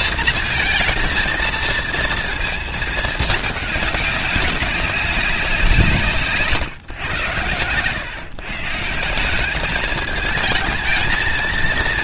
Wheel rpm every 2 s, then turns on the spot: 230, 210, 190, 120, 190, 230.
none